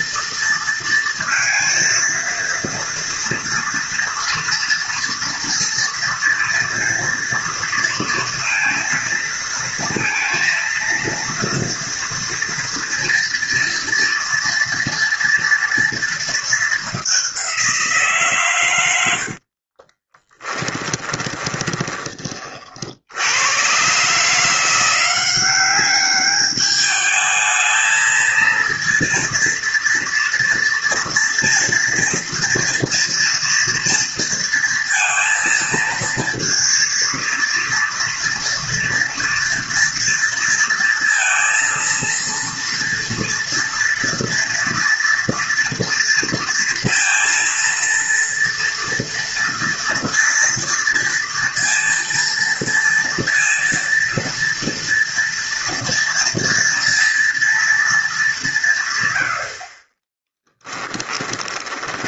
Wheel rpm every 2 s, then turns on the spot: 230, 230, 230, 230, 230, 230, 230, 230, 190, 60, 20, 110, 190, 220, 230, 230, 230, 230, 230, 230, 230, 230, 230, 230, 230, 240, 230, 230, 230, 50, 20.
18-22 60-62